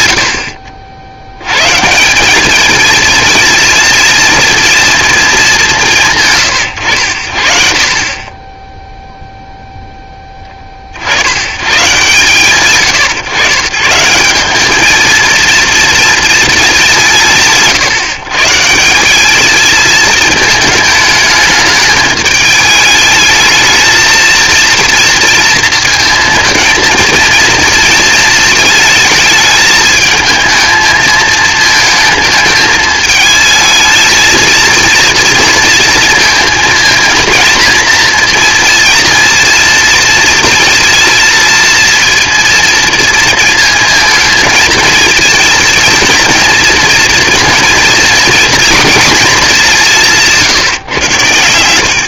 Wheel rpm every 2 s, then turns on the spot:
70, 210, 230, 110, 10, 30, 130, 210, 210, 150, 220, 220, 230, 220, 220, 220, 220, 230, 230, 230, 230, 230, 230, 230, 230, 150.
none